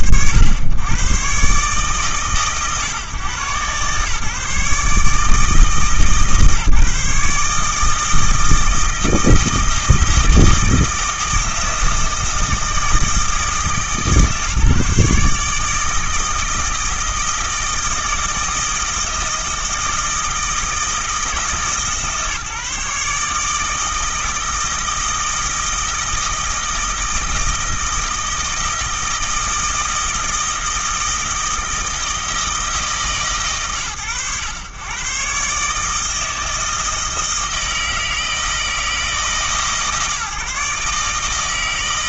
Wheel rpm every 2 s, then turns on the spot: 100, 130, 150, 150, 160, 160, 160, 150, 160, 160, 160, 150, 160, 160, 160, 160, 160, 120, 160, 160, 150.
none